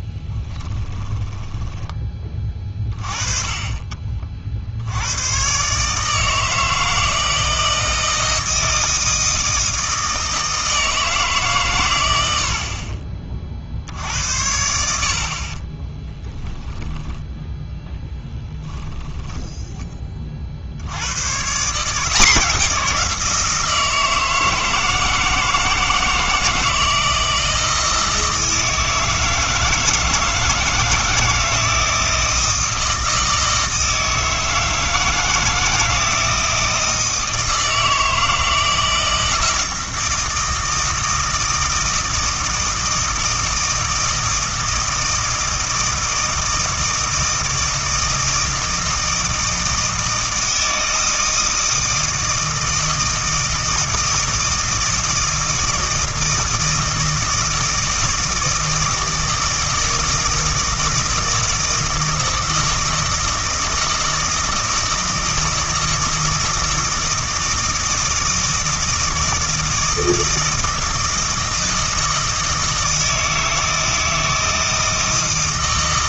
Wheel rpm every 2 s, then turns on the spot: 10, 30, 80, 160, 160, 160, 40, 70, 10, 10, 90, 180, 160, 160, 160, 160, 160, 160, 160, 160, 160, 160, 160, 160, 160, 160, 160, 160, 160, 160, 160, 160, 160, 170, 160, 160, 160, 160.
0-2 16-20